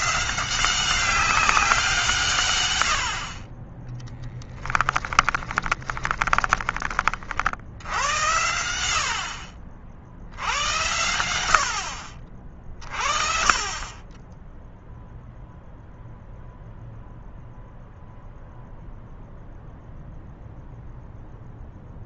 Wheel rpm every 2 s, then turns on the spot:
190, 100, 20, 30, 80, 90, 40, 0, 0, 0, 0.
4-6